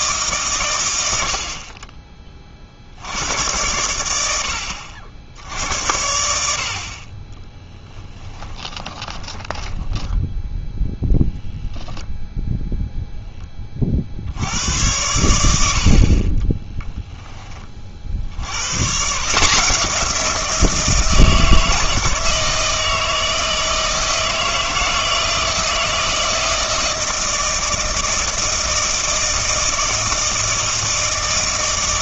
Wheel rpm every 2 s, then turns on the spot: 110, 50, 70, 60, 20, 0, 0, 90, 10, 120, 170, 160, 160, 160, 160, 160.
8-10 16-18